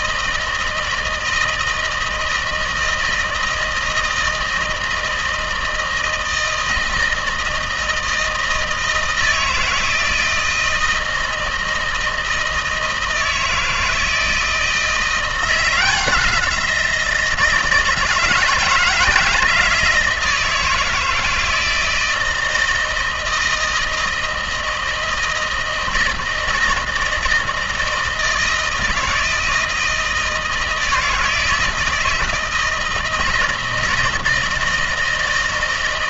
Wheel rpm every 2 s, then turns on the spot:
160, 160, 160, 160, 160, 160, 160, 160, 170, 160, 160, 160, 160, 160, 160, 160, 160, 160.
none